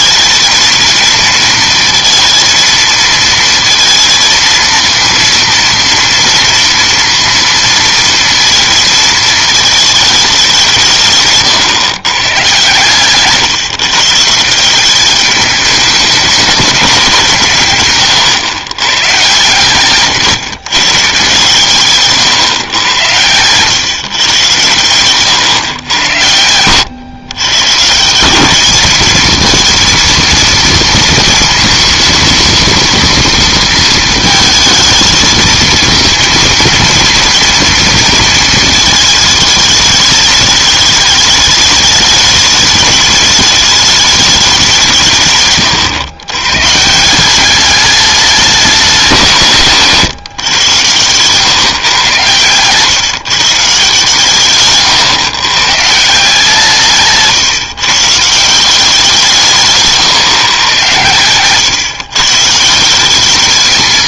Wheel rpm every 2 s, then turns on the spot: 220, 220, 230, 230, 230, 180, 120, 170, 200, 120, 130, 110, 120, 100, 200, 230, 230, 220, 230, 220, 220, 210, 190, 130, 190, 130, 120, 140, 160, 170, 130, 160.
none